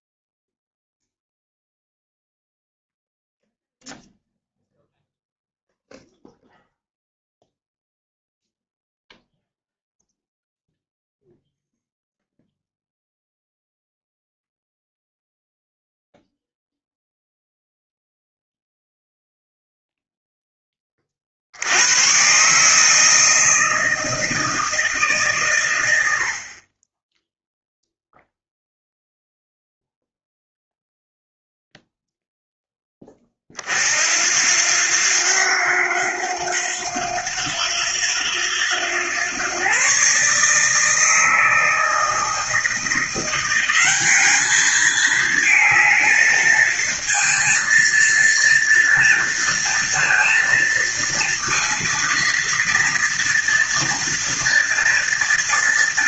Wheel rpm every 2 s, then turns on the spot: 0, 0, 0, 0, 0, 0, 0, 0, 0, 0, 20, 150, 160, 20, 0, 0, 10, 90, 90, 100, 160, 170, 220, 220, 230, 230, 230, 230.
none